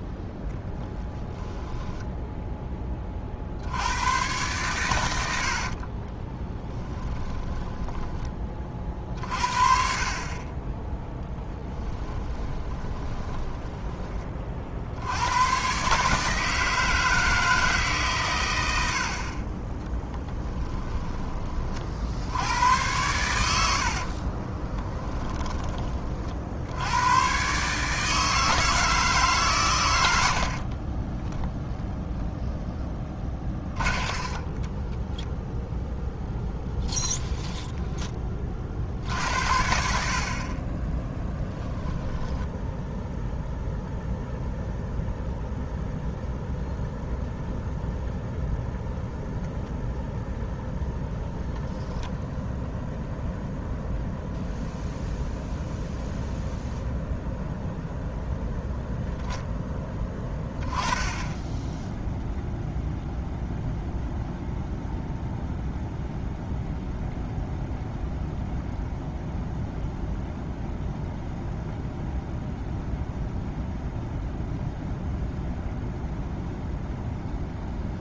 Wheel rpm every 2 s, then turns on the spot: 10, 20, 110, 10, 40, 10, 20, 60, 160, 70, 10, 100, 10, 90, 160, 30, 10, 10, 0, 60, 20, 0, 0, 0, 0, 0, 0, 0, 0, 0, 20, 0, 0, 0, 0, 0, 0, 0, 0.
6-8 12-14 20-22 24-26 30-36